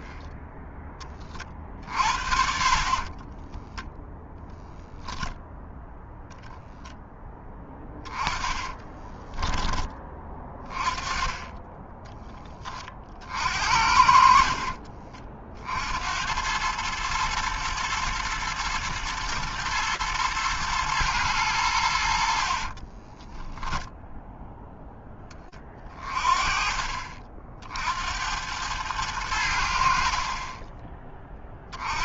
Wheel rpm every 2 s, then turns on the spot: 10, 50, 0, 0, 20, 20, 10, 60, 90, 120, 110, 50, 0, 30, 90, 30.
8-10 22-24